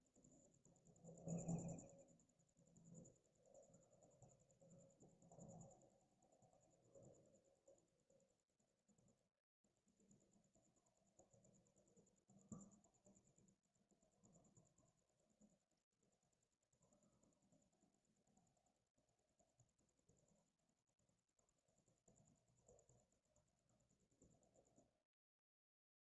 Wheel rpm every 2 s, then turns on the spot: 0, 0, 0, 0, 0, 0, 0, 0, 0, 0, 0, 0, 0.
none